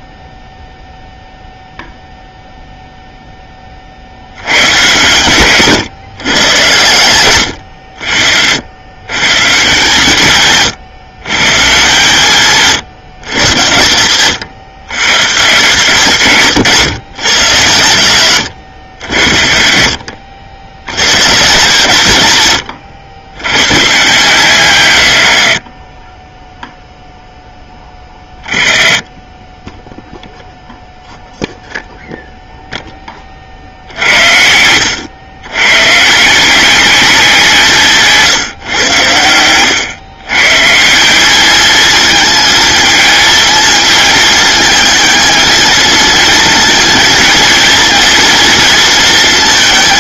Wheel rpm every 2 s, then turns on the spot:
0, 0, 130, 120, 100, 130, 150, 130, 140, 100, 80, 110, 140, 0, 20, 0, 0, 80, 190, 120, 150, 220, 220, 230, 230.
none